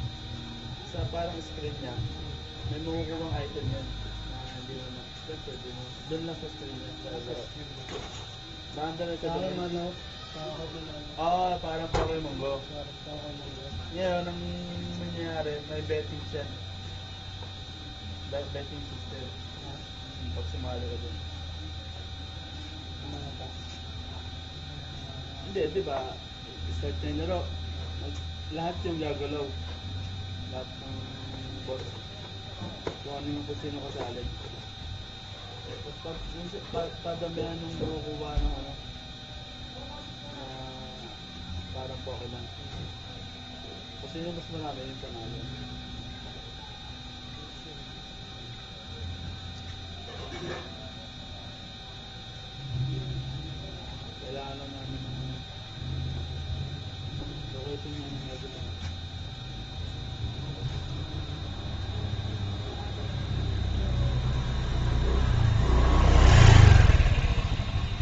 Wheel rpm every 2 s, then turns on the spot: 0, 0, 0, 0, 0, 0, 0, 0, 0, 0, 0, 0, 0, 0, 0, 0, 0, 0, 0, 0, 0, 0, 0, 0, 0, 0, 0, 0, 0, 0, 0, 0, 0, 0.
none